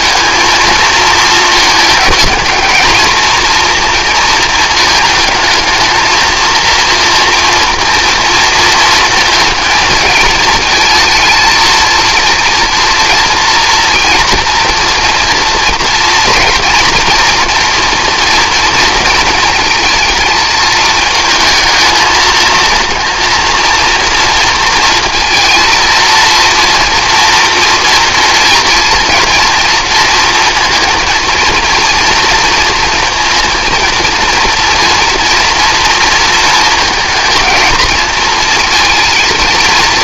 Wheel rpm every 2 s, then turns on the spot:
230, 220, 220, 230, 230, 230, 230, 230, 240, 230, 230, 230, 230, 230, 240, 230, 230, 230, 230, 230.
none